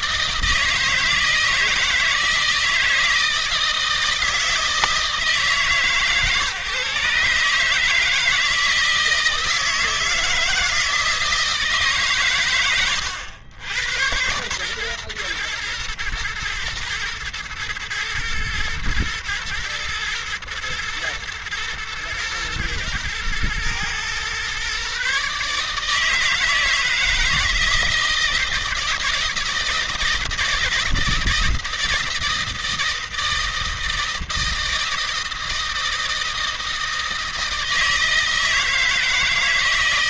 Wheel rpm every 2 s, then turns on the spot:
160, 160, 160, 140, 160, 160, 120, 120, 110, 120, 110, 110, 130, 160, 160, 160, 160, 160, 160, 160.
none